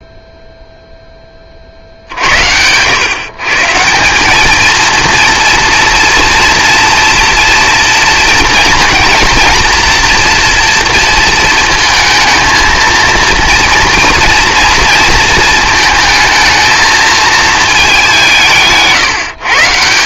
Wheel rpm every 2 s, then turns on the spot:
0, 70, 200, 230, 230, 230, 220, 230, 220, 170.
none